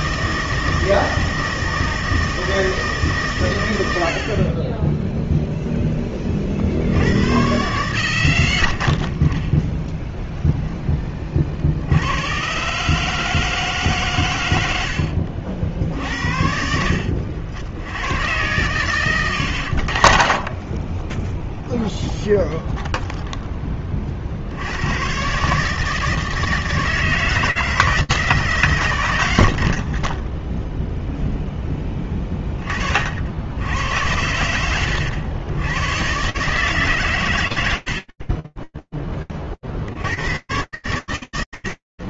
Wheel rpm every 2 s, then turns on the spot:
160, 130, 0, 80, 20, 20, 150, 80, 70, 110, 20, 0, 110, 160, 100, 0, 40, 90, 150, 0, 100.
none